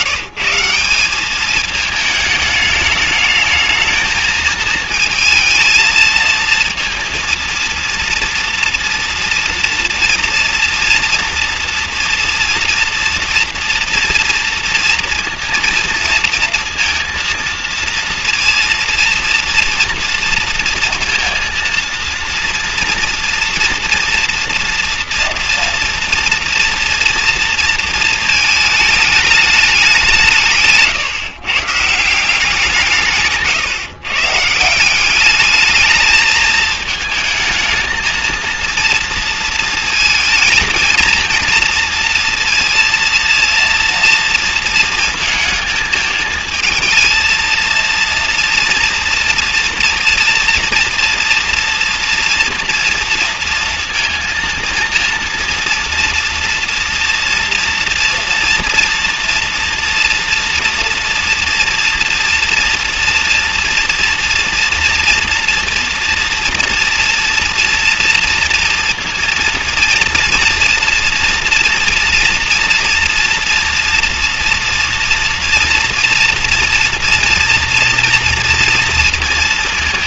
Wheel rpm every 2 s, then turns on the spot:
170, 210, 220, 230, 230, 230, 230, 230, 230, 230, 230, 230, 230, 230, 220, 150, 170, 170, 220, 230, 230, 230, 230, 220, 230, 230, 230, 230, 230, 230, 230, 240, 230, 230, 230, 240, 230, 230, 230, 230.
none